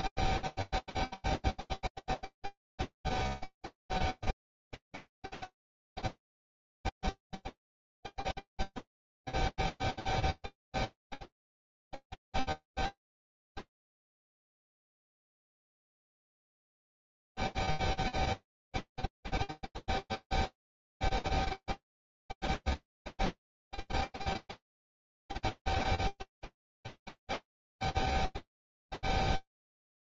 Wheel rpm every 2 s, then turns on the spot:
0, 0, 0, 0, 0, 0, 0, 0, 0, 0, 0, 0, 0, 0, 0.
none